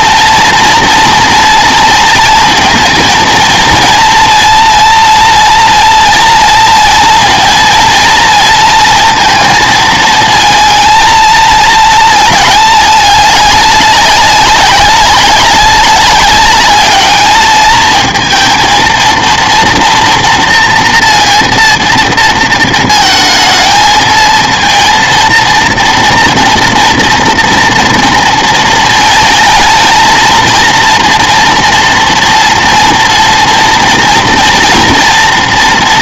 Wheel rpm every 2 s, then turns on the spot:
230, 230, 240, 230, 230, 230, 210, 190, 210, 230, 240, 220, 230, 230, 220, 230, 240, 240.
none